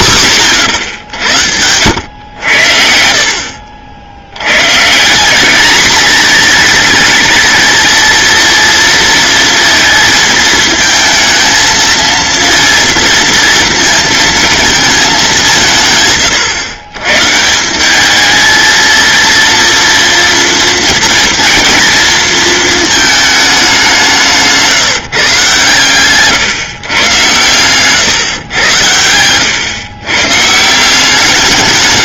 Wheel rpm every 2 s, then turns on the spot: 110, 70, 140, 220, 230, 220, 230, 220, 120, 220, 230, 220, 160, 140, 110, 170.
none